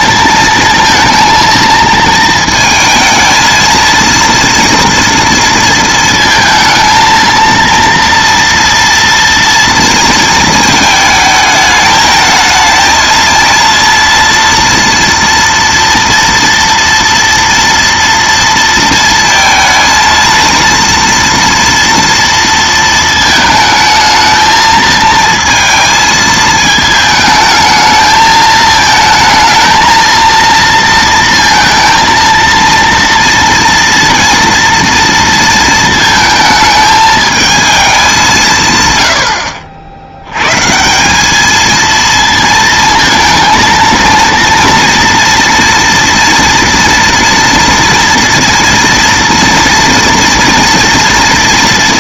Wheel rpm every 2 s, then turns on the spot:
220, 220, 230, 220, 230, 220, 220, 230, 230, 230, 230, 230, 220, 220, 220, 230, 230, 230, 220, 160, 140, 230, 230, 230, 230, 230.
none